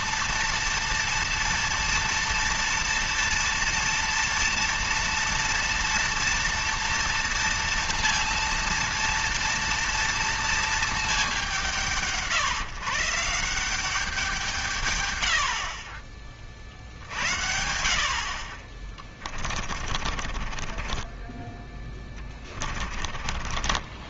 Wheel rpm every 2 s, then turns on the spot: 230, 240, 230, 230, 230, 230, 150, 150, 40, 30, 30, 30.
18-24